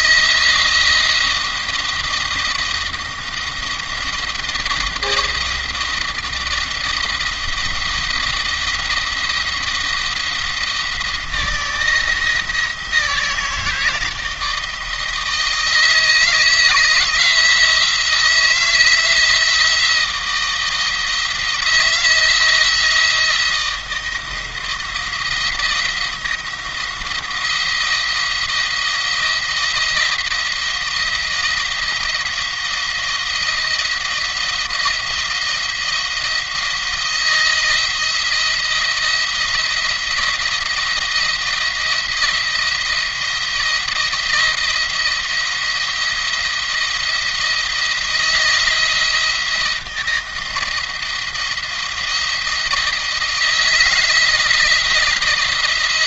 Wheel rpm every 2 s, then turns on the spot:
170, 170, 170, 170, 160, 170, 160, 160, 160, 160, 170, 170, 170, 170, 170, 170, 170, 170, 170, 170, 170, 170, 170, 160, 170, 170, 170, 160.
none